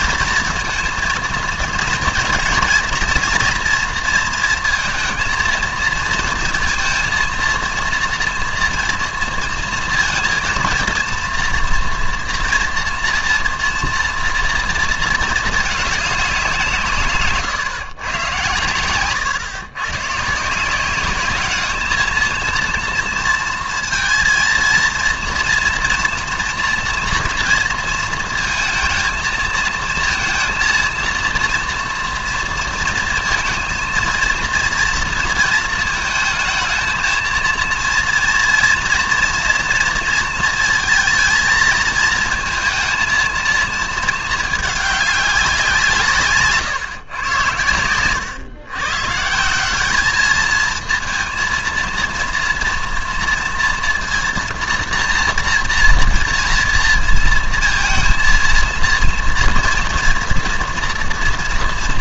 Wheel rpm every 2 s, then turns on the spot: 230, 230, 230, 230, 230, 230, 230, 230, 170, 120, 170, 230, 230, 230, 230, 230, 230, 230, 230, 230, 220, 230, 210, 140, 130, 220, 230, 230, 230, 230, 230.
46-48